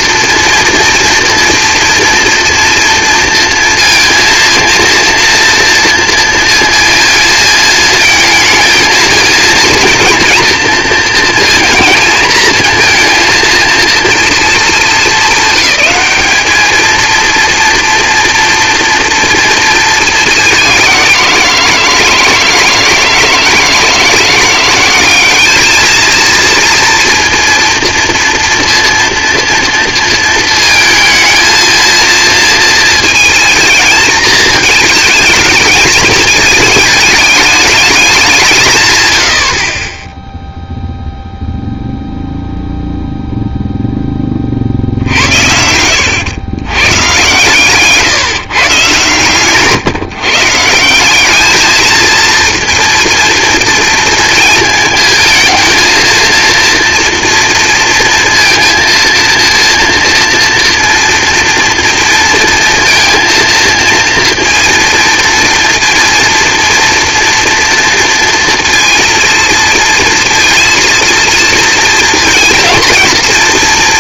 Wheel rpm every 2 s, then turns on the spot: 230, 230, 230, 230, 220, 230, 230, 210, 210, 230, 200, 160, 180, 230, 240, 230, 230, 220, 220, 140, 0, 0, 50, 110, 140, 160, 230, 220, 240, 230, 230, 230, 230, 230, 230, 230, 230.
none